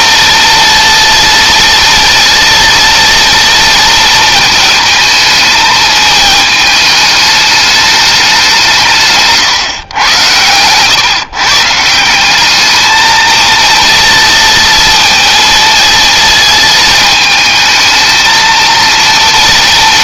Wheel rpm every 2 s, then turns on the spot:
230, 230, 220, 210, 150, 140, 220, 230, 220, 230.
none